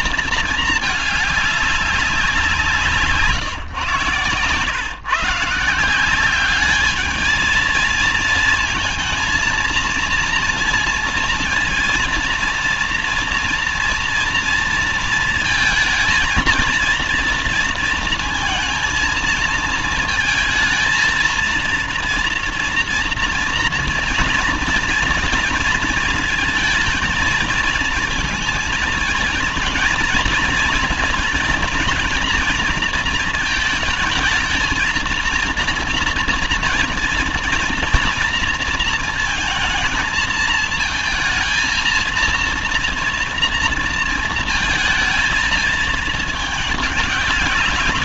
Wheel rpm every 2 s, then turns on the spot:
220, 170, 130, 200, 220, 230, 230, 230, 230, 230, 220, 230, 230, 230, 220, 230, 230, 220, 230, 230, 220, 230, 220, 210.
none